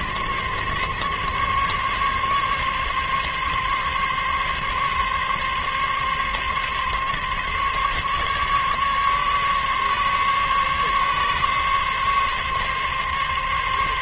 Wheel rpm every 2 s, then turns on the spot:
140, 140, 140, 140, 140, 140, 140.
none